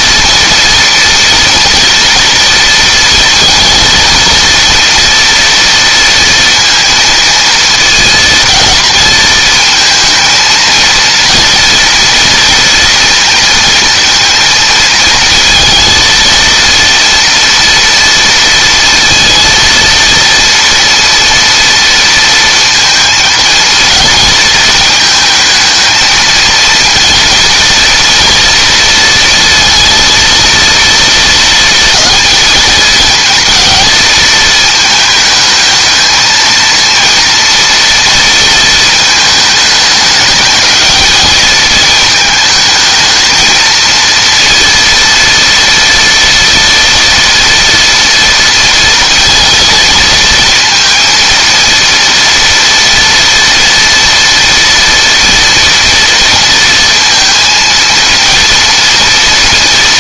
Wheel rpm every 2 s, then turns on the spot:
230, 230, 230, 230, 230, 230, 230, 230, 230, 230, 230, 230, 220, 230, 230, 230, 220, 220, 230, 220, 210, 220, 230, 230, 230, 230, 230, 230, 230, 230.
none